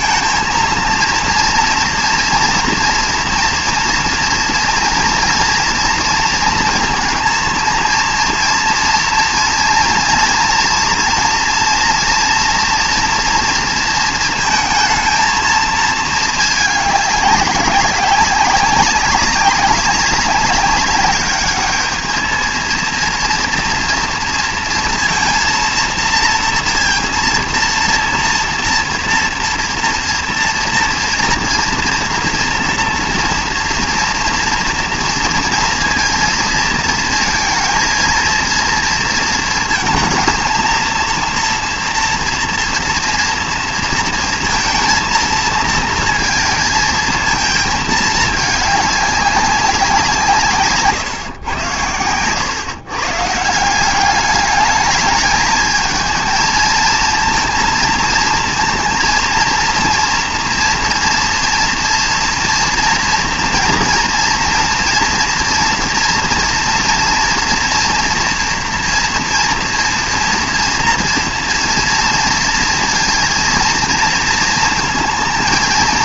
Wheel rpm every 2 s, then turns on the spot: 230, 230, 230, 230, 230, 230, 230, 230, 210, 200, 200, 230, 230, 230, 230, 230, 230, 230, 230, 230, 230, 230, 230, 220, 210, 140, 130, 210, 230, 230, 230, 230, 230, 230, 230, 240, 230, 230.
none